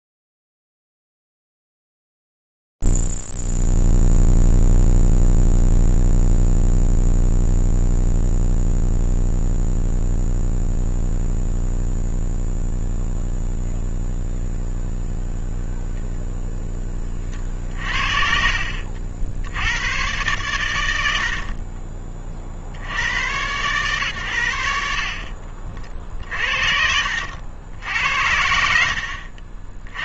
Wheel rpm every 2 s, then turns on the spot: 0, 0, 0, 0, 0, 0, 0, 0, 0, 60, 110, 50, 70, 50, 70.
18-20